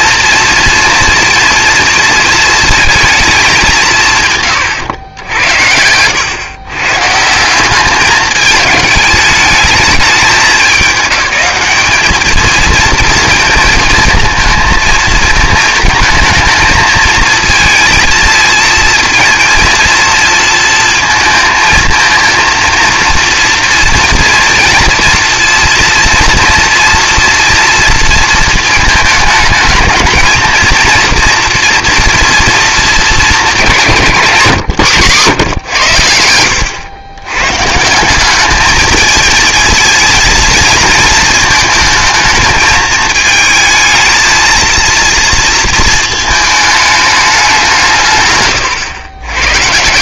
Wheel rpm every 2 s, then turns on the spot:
230, 220, 120, 120, 220, 210, 220, 220, 220, 230, 230, 230, 230, 230, 220, 240, 230, 140, 80, 210, 220, 220, 230, 210, 130.
none